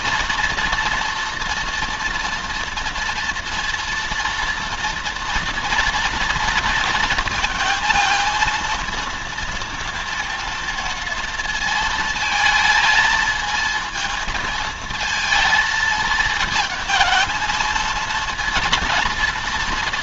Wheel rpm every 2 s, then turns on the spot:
230, 230, 230, 230, 230, 230, 220, 220, 220, 230.
none